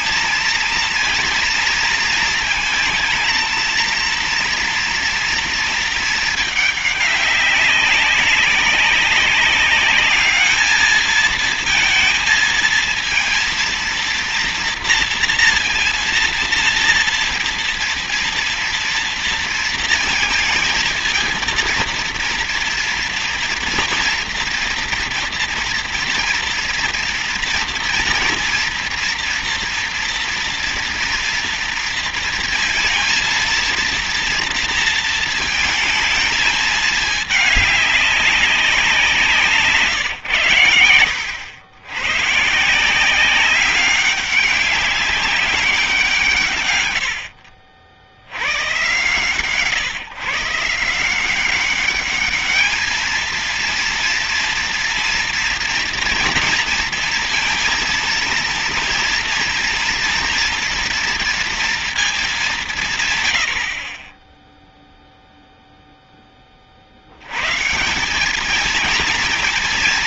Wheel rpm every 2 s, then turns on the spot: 230, 230, 230, 210, 200, 210, 230, 230, 230, 230, 230, 230, 230, 230, 230, 240, 230, 230, 220, 200, 110, 150, 200, 130, 110, 160, 210, 230, 230, 230, 230, 190, 10, 30, 220.
none